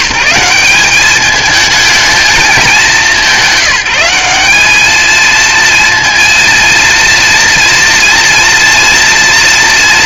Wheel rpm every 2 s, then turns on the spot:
170, 210, 200, 230, 230.
none